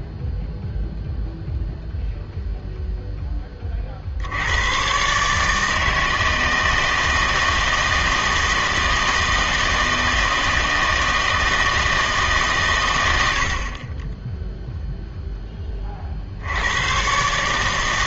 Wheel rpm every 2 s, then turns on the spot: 0, 0, 110, 160, 160, 160, 130, 0, 100.
none